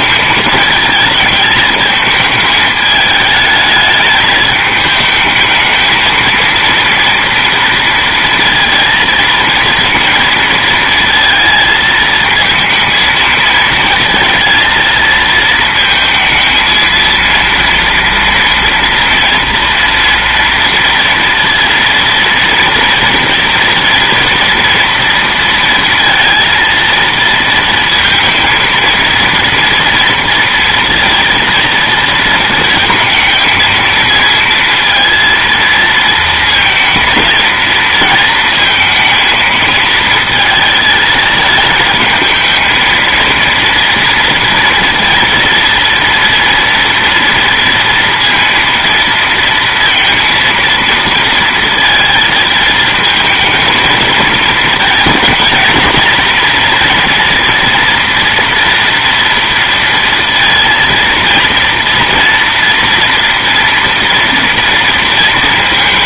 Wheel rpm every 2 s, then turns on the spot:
220, 210, 220, 230, 230, 230, 220, 230, 230, 230, 230, 230, 230, 230, 230, 230, 220, 230, 230, 230, 220, 220, 230, 230, 230, 230, 220, 220, 240, 230, 230, 240, 230.
none